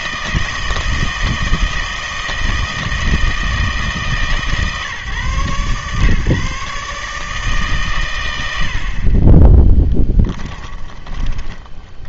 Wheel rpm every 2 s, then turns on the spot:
160, 160, 140, 150, 60, 20.
10-12